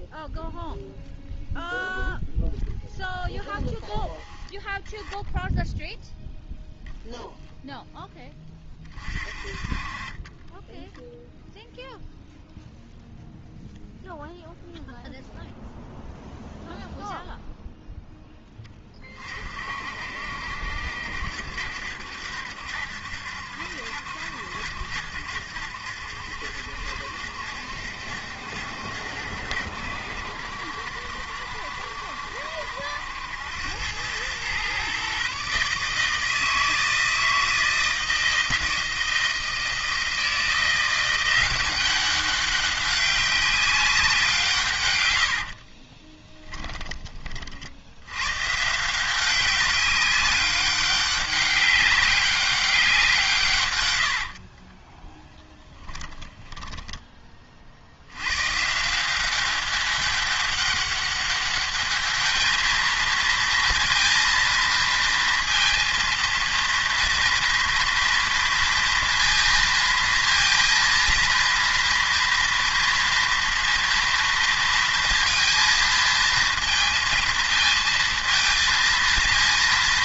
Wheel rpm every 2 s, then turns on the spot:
0, 0, 10, 0, 20, 10, 0, 0, 0, 10, 60, 70, 70, 70, 70, 70, 70, 120, 160, 160, 170, 200, 140, 10, 140, 190, 190, 30, 10, 140, 200, 220, 230, 230, 230, 230, 230, 230, 230, 230.
10-12 54-58